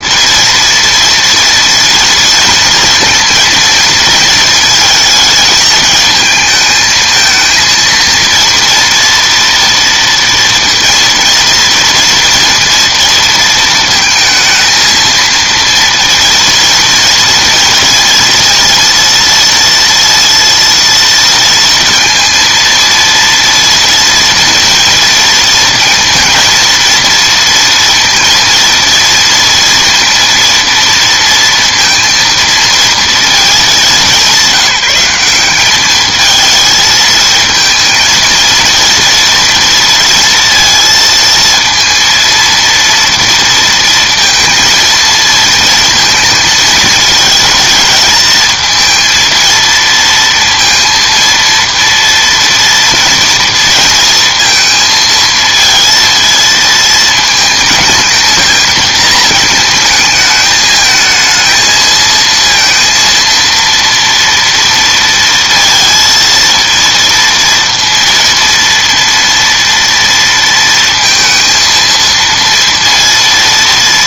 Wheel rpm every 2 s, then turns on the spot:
230, 230, 230, 220, 230, 230, 230, 220, 230, 230, 230, 230, 230, 230, 230, 230, 230, 180, 220, 230, 230, 230, 230, 220, 220, 230, 240, 230, 220, 220, 220, 230, 230, 230, 230, 230, 230.
none